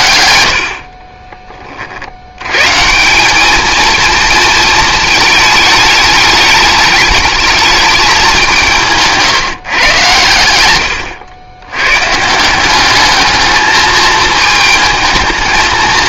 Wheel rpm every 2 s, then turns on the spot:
60, 140, 220, 210, 170, 100, 190, 220.
none